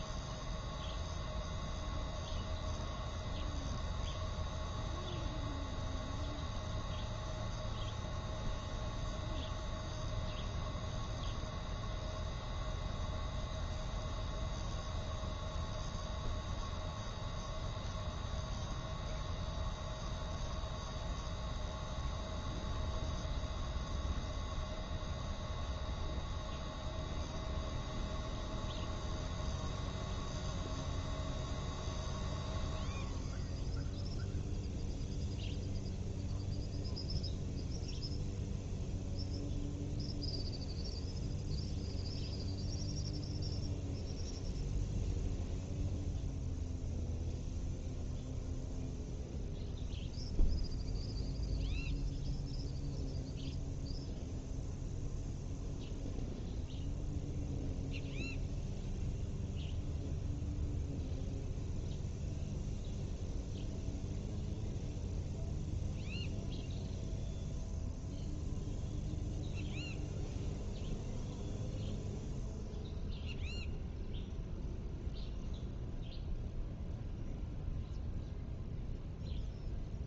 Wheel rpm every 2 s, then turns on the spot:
0, 0, 0, 0, 0, 0, 0, 0, 0, 0, 0, 0, 0, 0, 0, 0, 0, 0, 0, 0, 0, 0, 0, 0, 0, 0, 0, 0, 0, 0, 0, 0, 0, 0, 0, 0, 0, 0, 0, 0.
none